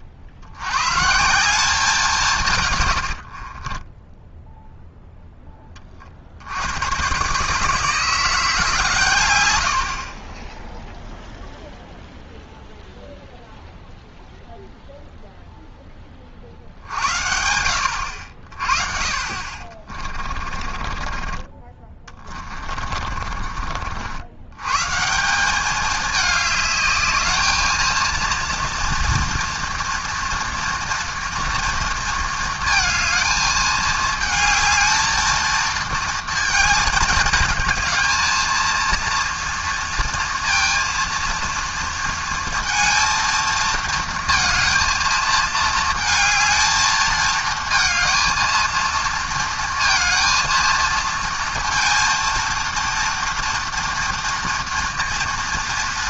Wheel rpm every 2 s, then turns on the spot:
110, 130, 0, 90, 150, 0, 0, 0, 60, 50, 40, 30, 120, 210, 230, 230, 220, 220, 230, 230, 230, 230, 230, 220, 230, 230, 230, 230.
2-4 20-24